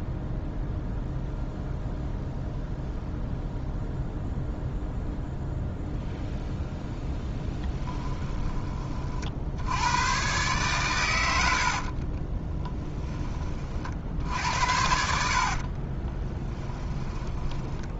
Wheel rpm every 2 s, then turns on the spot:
0, 0, 0, 0, 20, 120, 10, 70, 10.
12-18